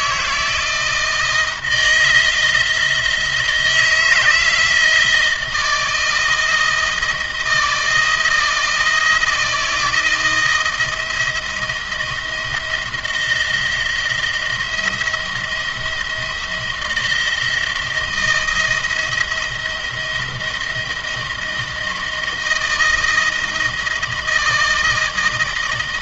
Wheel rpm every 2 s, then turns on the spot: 160, 160, 160, 160, 160, 170, 160, 170, 170, 170, 170, 160, 160.
none